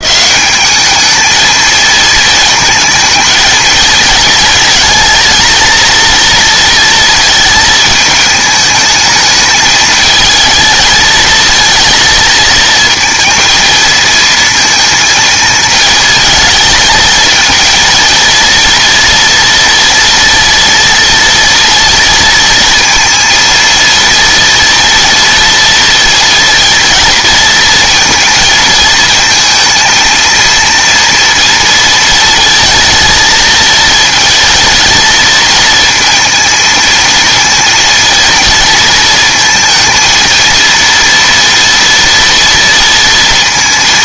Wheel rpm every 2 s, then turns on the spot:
210, 220, 230, 230, 220, 220, 220, 230, 220, 230, 230, 220, 230, 230, 220, 230, 220, 230, 220, 230, 230, 230.
none